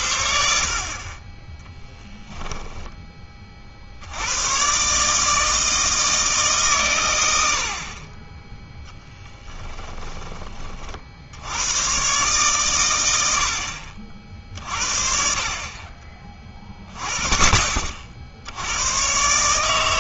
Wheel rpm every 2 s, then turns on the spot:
60, 10, 120, 150, 10, 30, 120, 60, 20, 90.
none